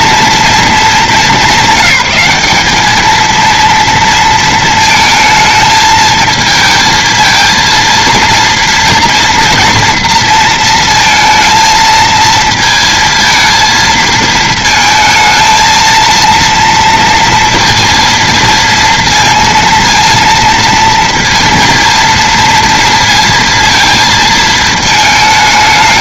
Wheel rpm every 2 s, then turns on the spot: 220, 210, 220, 220, 230, 230, 220, 220, 230, 230, 230, 230, 220.
none